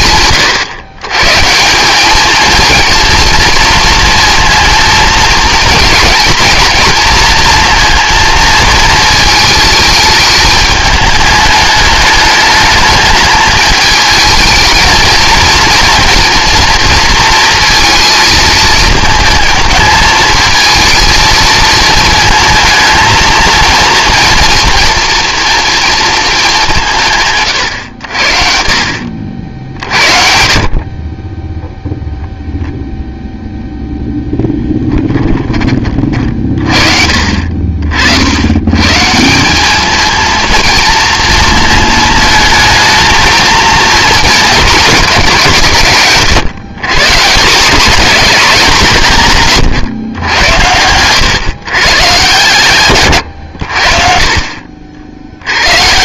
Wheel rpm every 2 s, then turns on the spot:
120, 230, 230, 220, 220, 210, 210, 220, 230, 220, 220, 230, 230, 190, 50, 50, 0, 10, 40, 120, 230, 220, 210, 130, 190, 100, 130, 50.
50-52